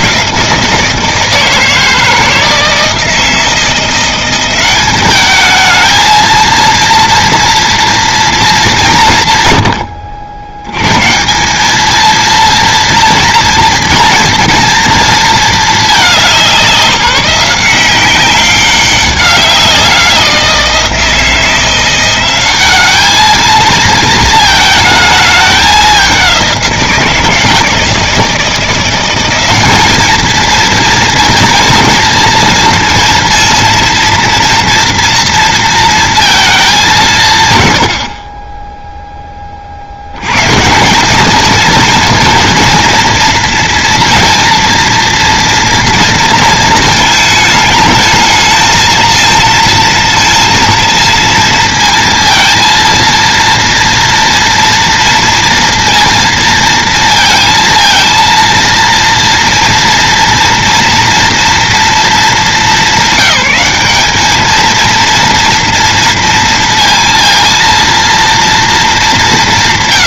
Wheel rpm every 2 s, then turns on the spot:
170, 160, 190, 230, 210, 100, 230, 230, 190, 200, 170, 200, 220, 180, 170, 230, 230, 230, 200, 10, 130, 230, 230, 230, 230, 230, 230, 240, 230, 230, 230, 200, 220, 230, 230.
none